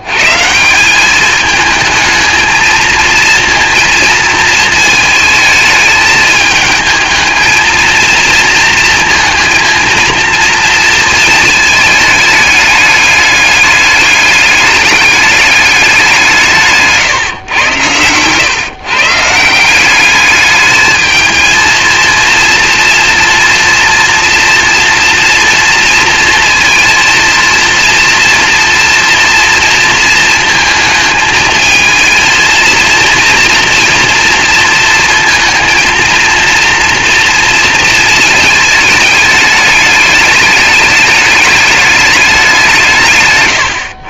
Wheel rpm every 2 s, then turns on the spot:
200, 230, 220, 220, 230, 230, 210, 200, 140, 140, 220, 230, 230, 230, 230, 220, 230, 230, 230, 210, 210, 160.
none